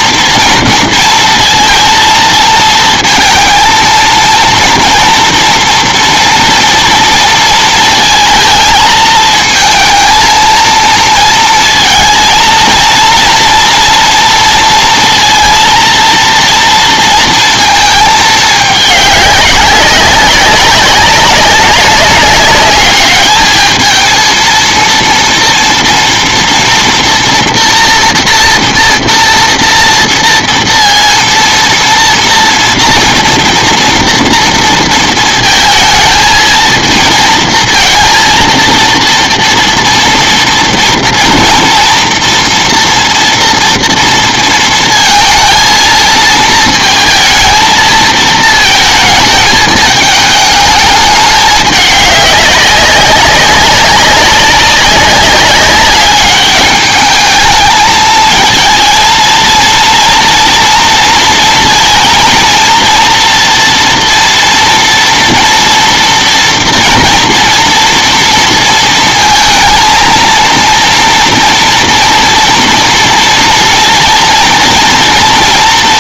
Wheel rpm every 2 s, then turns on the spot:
230, 230, 230, 230, 220, 230, 230, 230, 230, 200, 190, 200, 230, 230, 230, 230, 230, 230, 220, 230, 230, 240, 230, 220, 220, 210, 200, 200, 210, 220, 230, 230, 240, 230, 230, 230, 230, 230.
none